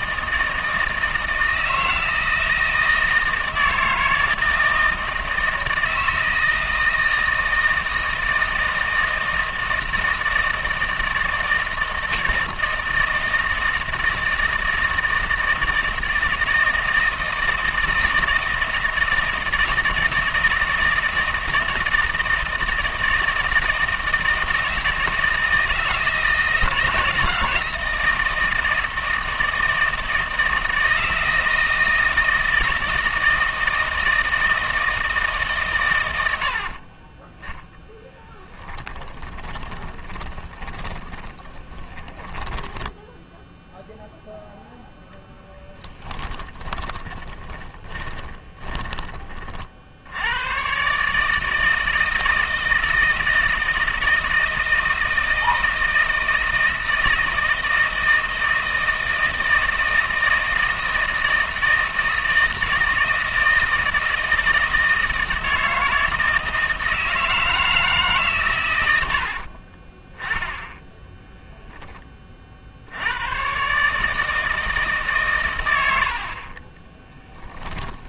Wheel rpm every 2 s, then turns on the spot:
160, 160, 160, 160, 160, 160, 160, 160, 160, 160, 160, 160, 160, 160, 160, 160, 160, 160, 60, 10, 20, 0, 0, 20, 20, 110, 160, 160, 160, 160, 160, 160, 160, 160, 110, 10, 50, 160, 40.
36-42 46-50 76-78